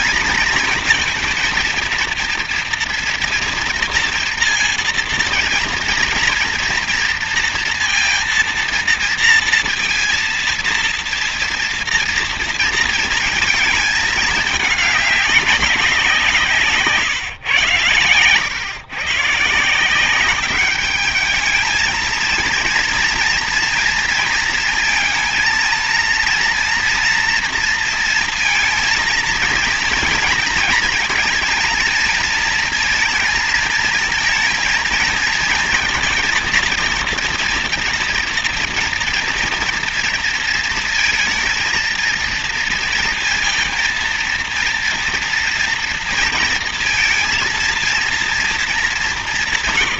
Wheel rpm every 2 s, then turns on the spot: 230, 230, 230, 230, 230, 230, 220, 190, 120, 160, 220, 230, 230, 230, 230, 230, 230, 230, 230, 230, 230, 230, 230, 230, 140.
none